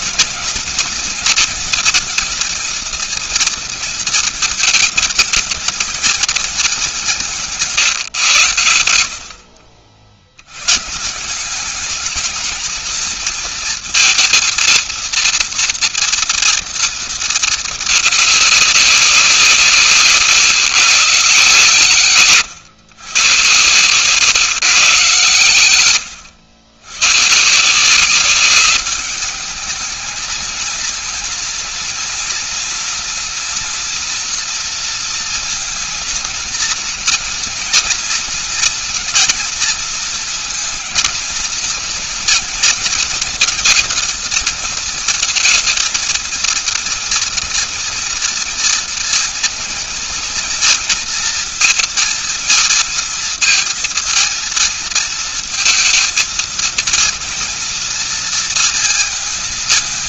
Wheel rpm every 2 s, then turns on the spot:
230, 230, 220, 210, 130, 90, 220, 230, 230, 210, 140, 140, 150, 100, 190, 220, 230, 240, 230, 230, 230, 240, 230, 230, 230, 230, 230, 230, 230, 230.
none